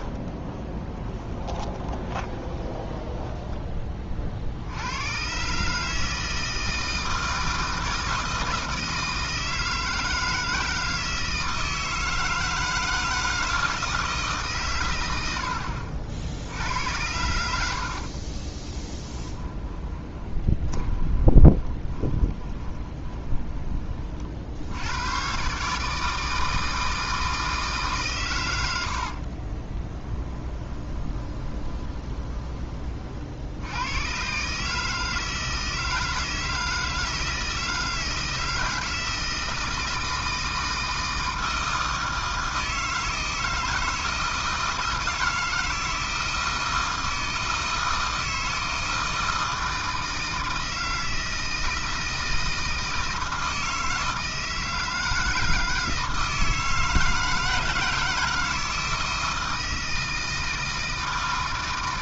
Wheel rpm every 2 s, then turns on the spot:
20, 20, 70, 160, 160, 160, 160, 120, 80, 30, 20, 20, 70, 160, 100, 10, 20, 150, 160, 160, 160, 160, 160, 160, 160, 160, 160, 160, 160, 160, 160.
0-4 18-24 30-32